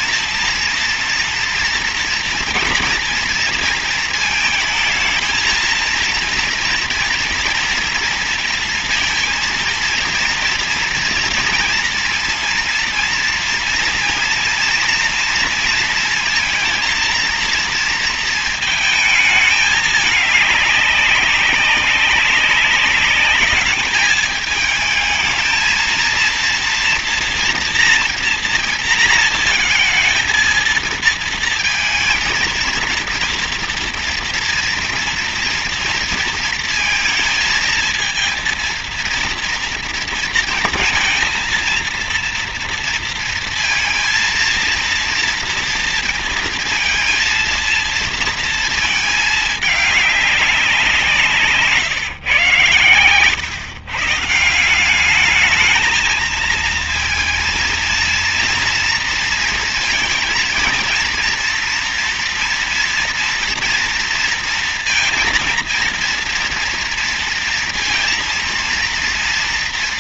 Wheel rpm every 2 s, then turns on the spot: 230, 230, 220, 230, 230, 230, 230, 230, 230, 220, 210, 200, 220, 230, 230, 230, 230, 230, 230, 230, 230, 230, 230, 230, 230, 190, 130, 170, 230, 230, 230, 230, 230, 240, 230.
none